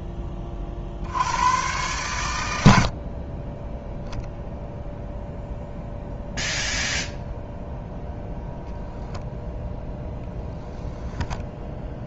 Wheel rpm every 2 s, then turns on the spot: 50, 70, 0, 0, 0, 0.
none